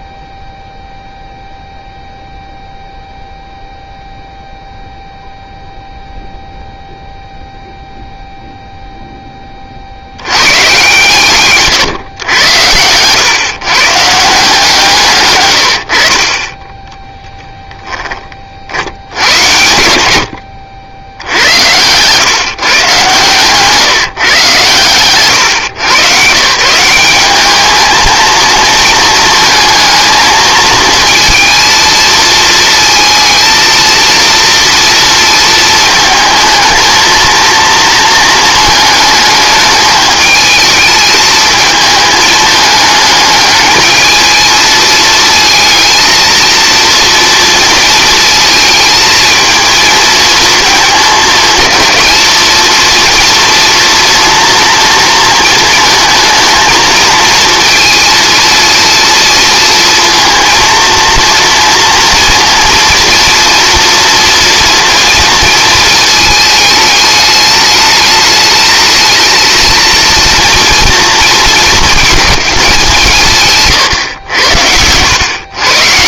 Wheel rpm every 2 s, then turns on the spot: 0, 0, 0, 0, 0, 110, 100, 160, 20, 60, 80, 140, 130, 160, 230, 220, 230, 230, 220, 220, 220, 220, 220, 230, 220, 220, 230, 230, 220, 230, 230, 230, 230, 220, 220, 230, 200, 90.
none